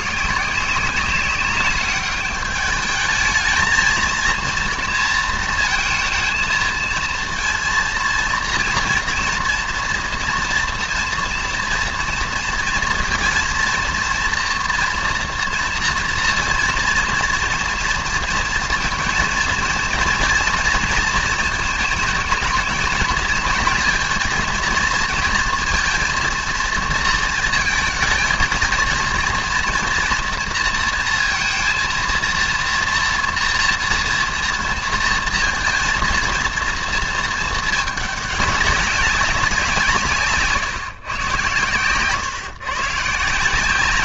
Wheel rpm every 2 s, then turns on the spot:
180, 200, 230, 220, 230, 230, 230, 230, 230, 230, 230, 220, 230, 230, 220, 230, 230, 230, 230, 200, 150, 140.
none